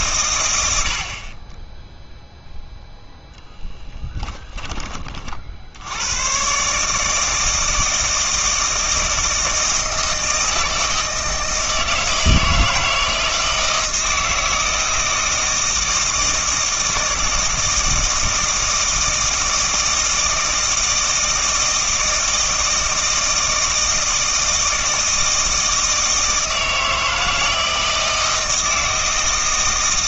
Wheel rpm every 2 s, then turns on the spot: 80, 0, 20, 130, 160, 160, 160, 160, 160, 160, 160, 160, 160, 160, 160.
none